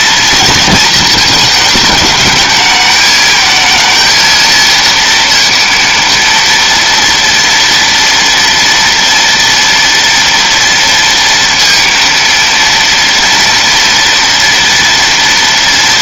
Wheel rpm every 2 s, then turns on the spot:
230, 210, 230, 230, 230, 230, 230, 240.
none